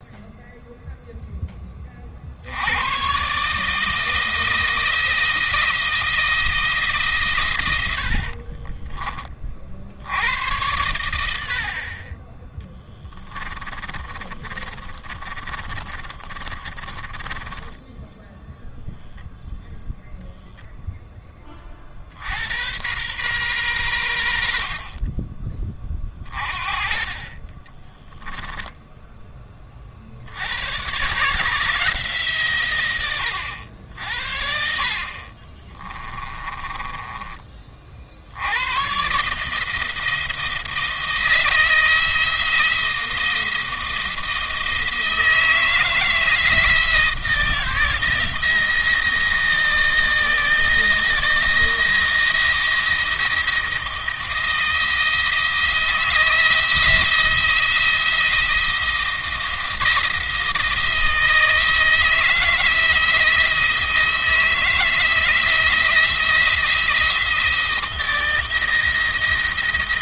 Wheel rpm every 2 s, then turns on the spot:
0, 110, 160, 150, 30, 100, 20, 30, 20, 0, 10, 110, 40, 30, 10, 120, 110, 40, 20, 120, 160, 170, 160, 160, 170, 170, 170, 160, 160, 170, 160, 170, 160, 170, 170.
12-18 36-38